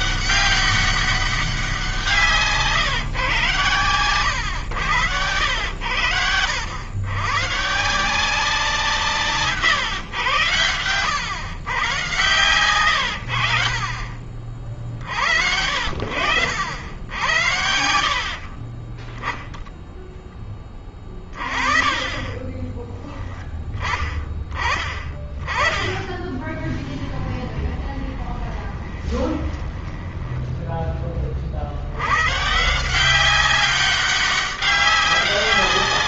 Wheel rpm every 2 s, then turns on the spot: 200, 150, 120, 90, 170, 100, 100, 50, 70, 30, 10, 20, 20, 10, 20, 10, 170, 200.
22-24 26-30